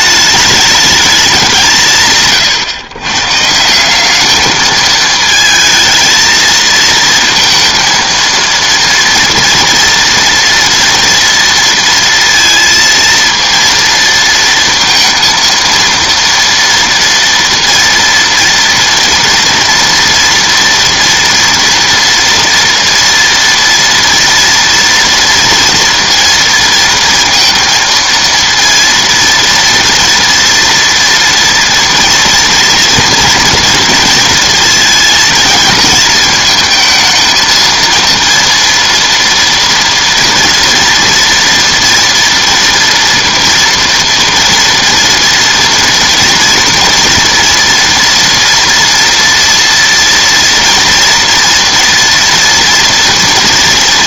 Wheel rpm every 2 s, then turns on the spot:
210, 140, 220, 220, 230, 230, 230, 230, 230, 230, 230, 230, 230, 230, 230, 230, 230, 230, 220, 230, 240, 240, 230, 230, 230, 240, 230.
none